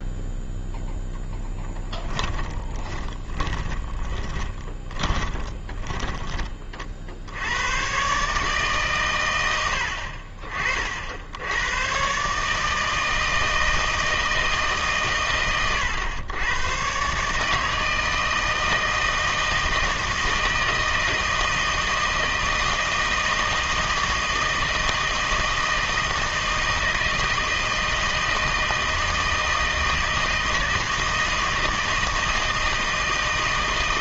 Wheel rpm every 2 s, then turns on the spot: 0, 20, 20, 40, 140, 50, 150, 150, 110, 160, 160, 160, 160, 160, 160, 160, 160.
2-6